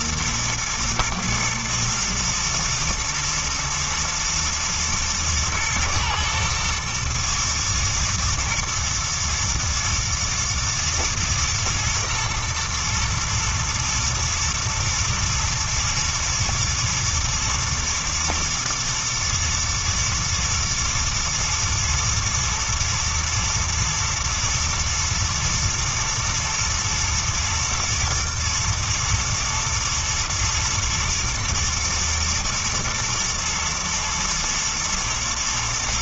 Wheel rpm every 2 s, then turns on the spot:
110, 120, 110, 110, 120, 110, 110, 120, 120, 110, 120, 120, 110, 110, 110, 120, 110, 110.
none